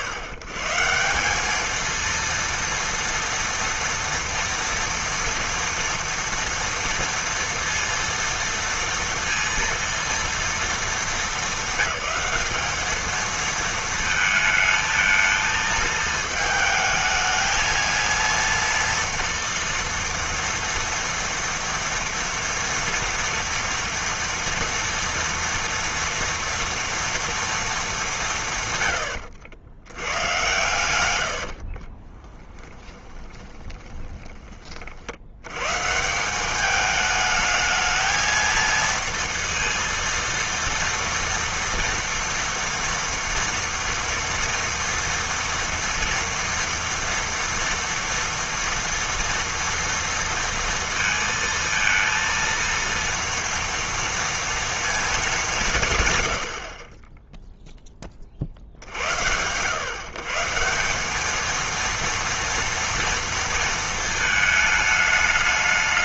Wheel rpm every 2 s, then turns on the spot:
140, 230, 230, 230, 230, 220, 210, 220, 220, 230, 230, 240, 240, 230, 140, 120, 10, 30, 200, 230, 230, 230, 230, 240, 230, 230, 230, 230, 60, 100, 170, 230, 220.
32-34